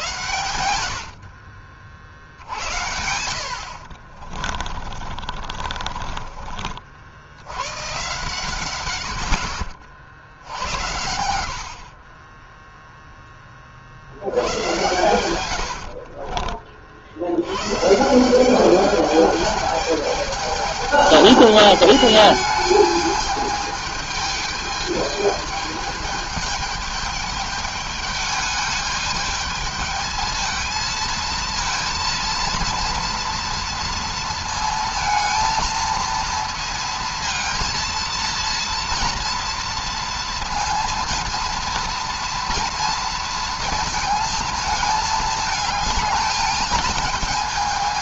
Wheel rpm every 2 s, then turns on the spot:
90, 60, 40, 40, 120, 70, 20, 110, 40, 190, 210, 210, 210, 210, 210, 220, 230, 230, 230, 230, 230, 230, 220, 220.
4-6